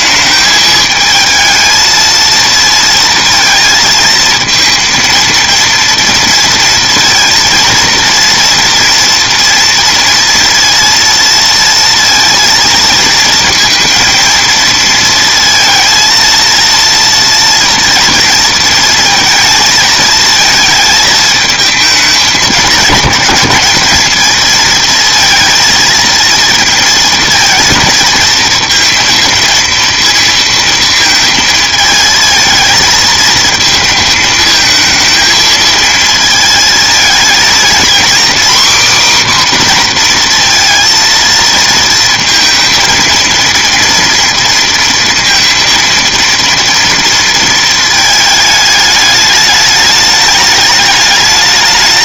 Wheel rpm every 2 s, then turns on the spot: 220, 230, 230, 230, 230, 230, 230, 230, 230, 230, 220, 210, 230, 230, 230, 230, 220, 220, 220, 260, 230, 230, 230, 230, 210, 210.
none